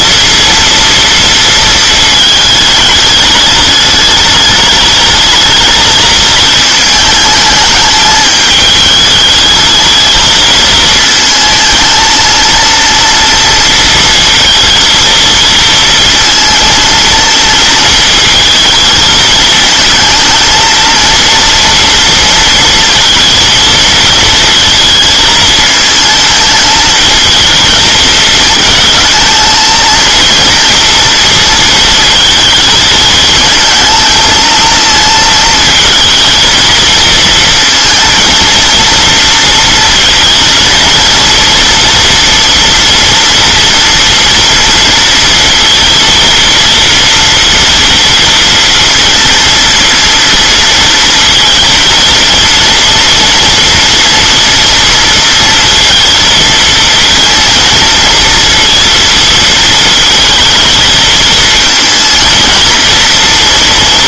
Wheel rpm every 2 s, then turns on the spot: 230, 220, 210, 220, 210, 220, 230, 230, 230, 220, 220, 230, 220, 220, 220, 230, 220, 230, 230, 230, 230, 240, 230, 230, 230, 230, 230, 230, 230, 230, 220, 230.
none